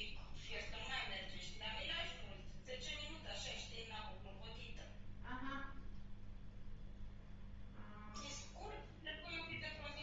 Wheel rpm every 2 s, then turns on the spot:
0, 0, 0, 0, 0.
none